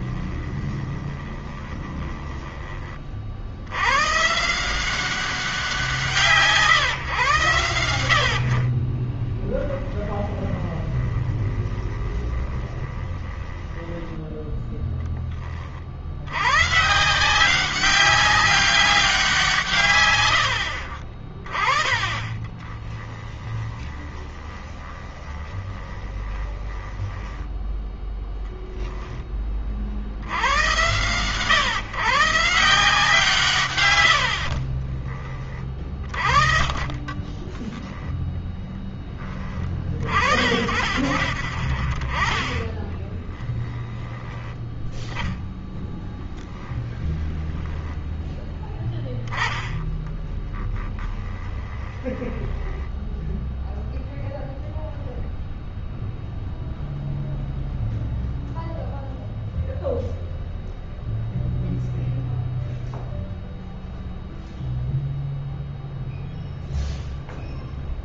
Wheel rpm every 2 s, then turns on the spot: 20, 30, 170, 130, 30, 20, 20, 10, 140, 190, 40, 20, 20, 20, 10, 100, 160, 40, 30, 10, 50, 30, 20, 0, 10, 20, 10, 10, 0, 0, 0, 0, 0, 0.
0-2 10-14 22-30 34-36 42-44 50-56